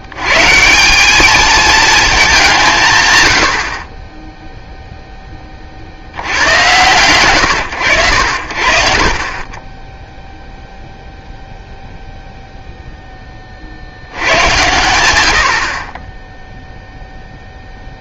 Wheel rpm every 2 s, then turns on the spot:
130, 190, 0, 60, 90, 0, 0, 110, 0.
none